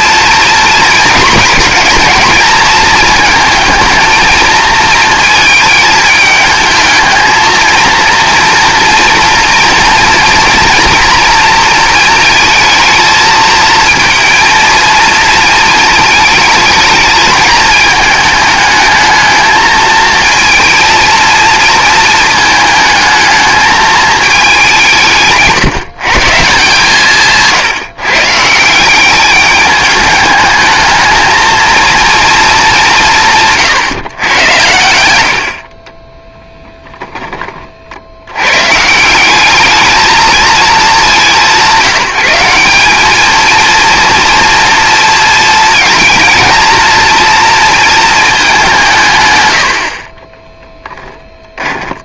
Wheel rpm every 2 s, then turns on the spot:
240, 230, 220, 220, 230, 230, 220, 220, 220, 220, 220, 220, 200, 140, 170, 220, 200, 90, 10, 140, 210, 190, 230, 230, 180, 10.
none